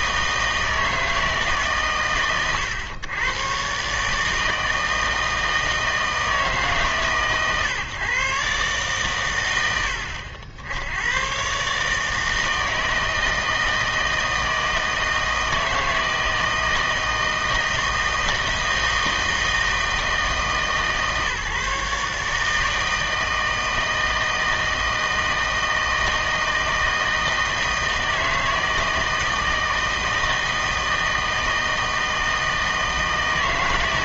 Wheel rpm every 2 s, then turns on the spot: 160, 120, 160, 150, 130, 80, 160, 160, 160, 160, 160, 150, 160, 160, 160, 160, 160.
none